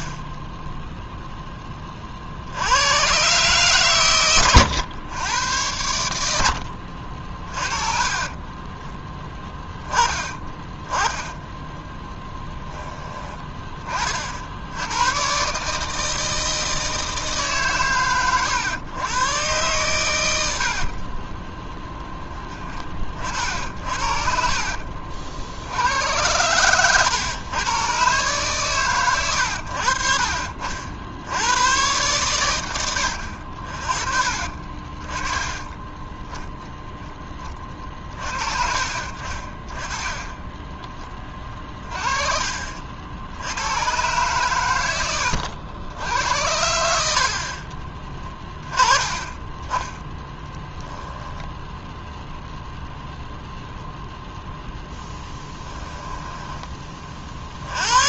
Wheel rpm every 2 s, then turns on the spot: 0, 100, 110, 60, 10, 10, 10, 100, 160, 120, 50, 40, 60, 100, 110, 70, 90, 30, 0, 40, 10, 60, 100, 70, 20, 20, 0, 0, 30.
10-12 20-22 50-52